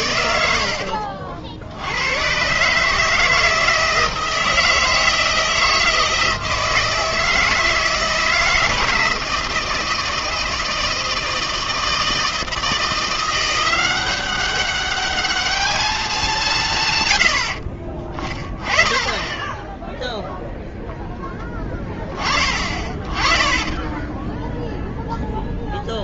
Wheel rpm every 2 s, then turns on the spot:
70, 130, 160, 160, 160, 160, 160, 200, 190, 20, 0, 20, 0.
none